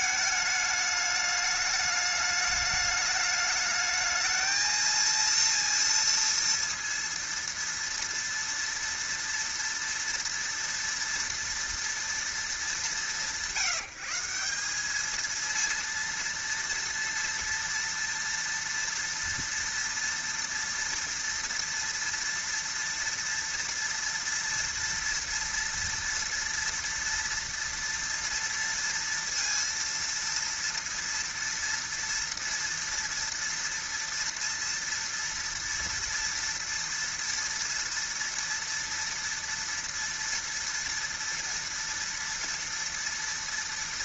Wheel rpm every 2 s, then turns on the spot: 210, 210, 220, 230, 230, 230, 210, 180, 230, 230, 230, 230, 230, 230, 230, 230, 230, 230, 230, 230, 230, 230.
none